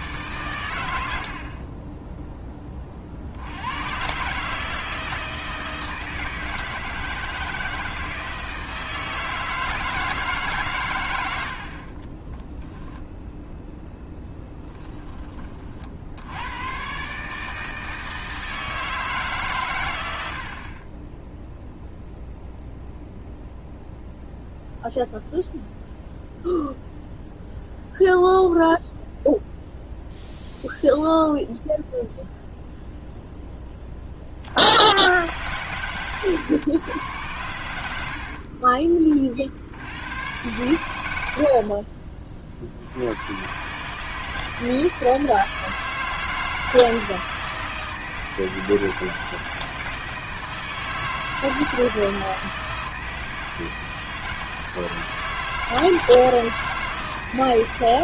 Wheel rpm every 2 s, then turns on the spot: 120, 20, 150, 160, 160, 140, 10, 10, 100, 160, 50, 0, 0, 0, 0, 0, 0, 80, 110, 40, 110, 50, 160, 160, 160, 160, 160, 160, 160.
12-14 38-40